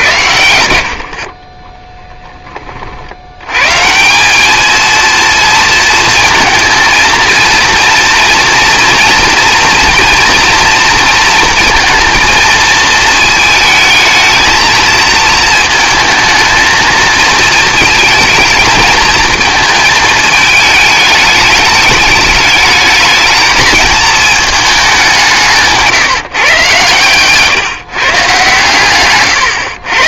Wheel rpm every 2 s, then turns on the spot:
80, 40, 220, 220, 230, 230, 230, 220, 220, 220, 210, 210, 210, 140, 130.
none